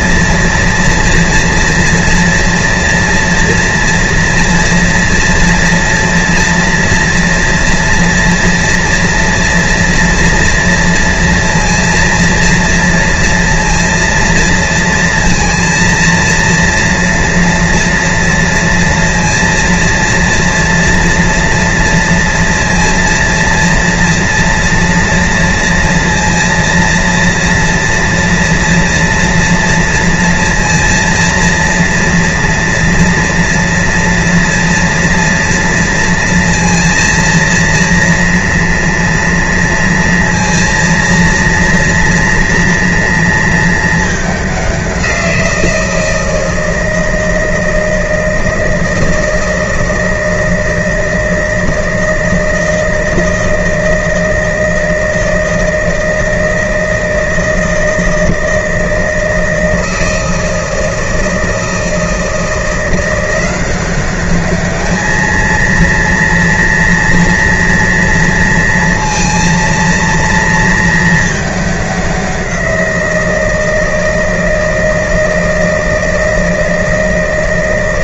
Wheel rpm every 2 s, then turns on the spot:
230, 240, 230, 230, 230, 230, 230, 230, 230, 230, 230, 230, 230, 230, 230, 230, 230, 230, 230, 230, 230, 230, 190, 160, 160, 160, 160, 160, 160, 160, 160, 170, 210, 240, 230, 230, 180, 160, 160.
none